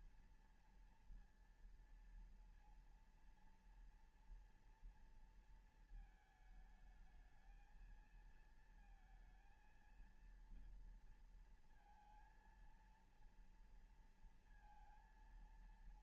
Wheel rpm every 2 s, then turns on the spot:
230, 230, 230, 220, 220, 230, 230, 230.
none